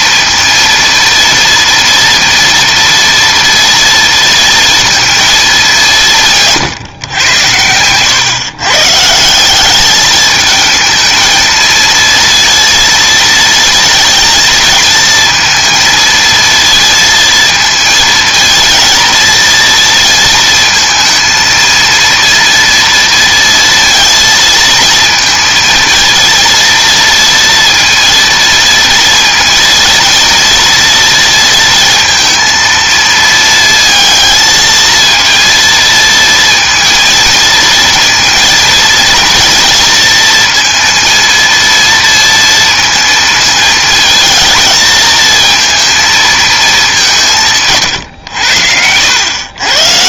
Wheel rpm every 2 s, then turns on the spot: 230, 230, 230, 150, 140, 220, 230, 230, 230, 230, 230, 230, 230, 230, 230, 230, 230, 230, 230, 230, 230, 230, 220, 210, 90.
none